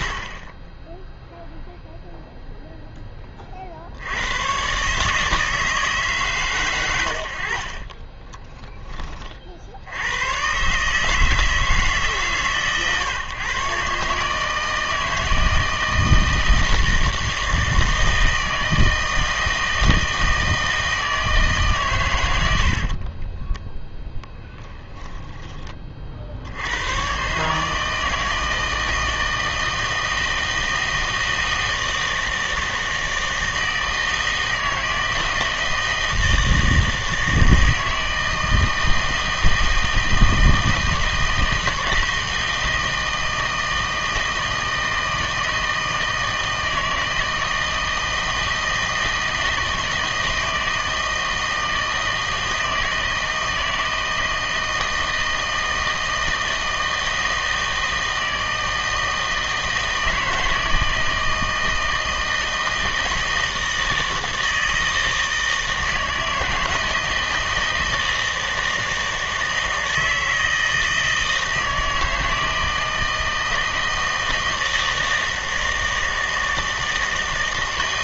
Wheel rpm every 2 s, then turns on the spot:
10, 0, 130, 100, 10, 140, 140, 160, 160, 160, 160, 60, 10, 90, 160, 160, 160, 160, 160, 160, 160, 160, 160, 160, 160, 160, 160, 160, 160, 160, 160, 160, 160, 160, 160, 160, 160, 160, 160.
0-2 22-24